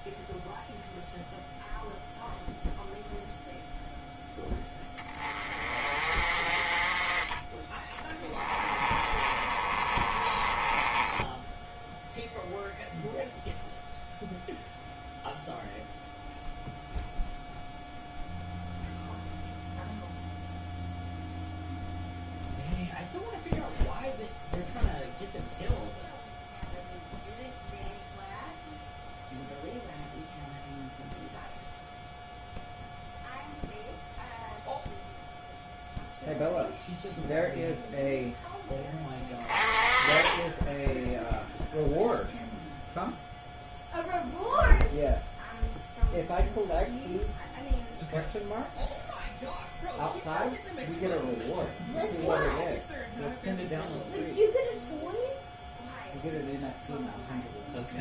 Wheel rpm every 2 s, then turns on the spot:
0, 0, 20, 30, 20, 10, 0, 0, 0, 0, 0, 0, 0, 0, 0, 0, 0, 0, 0, 10, 0, 0, 0, 0, 0, 0, 0, 0, 0.
8-12